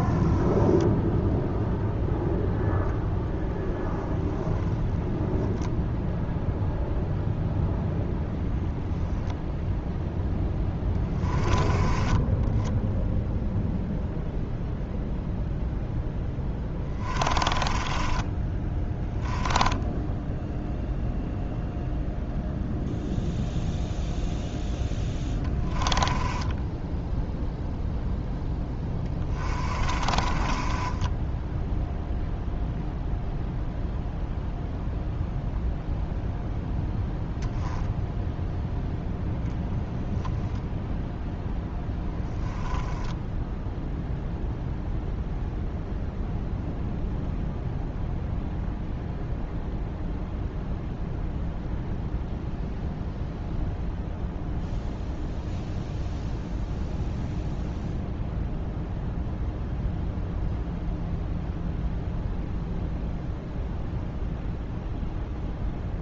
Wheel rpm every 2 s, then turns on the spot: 0, 0, 0, 0, 0, 10, 10, 0, 20, 10, 0, 0, 10, 10, 10, 20, 0, 0, 0, 0, 0, 10, 0, 0, 0, 0, 0, 0, 0, 0, 0, 0, 0.
10-14 16-20 24-32 42-44